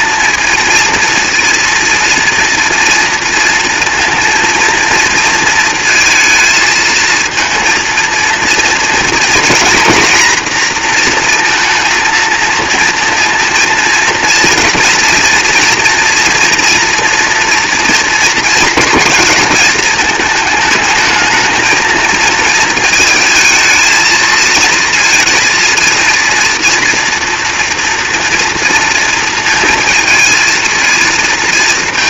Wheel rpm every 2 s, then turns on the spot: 230, 230, 230, 220, 230, 240, 230, 230, 230, 240, 220, 220, 220, 240, 230, 230.
none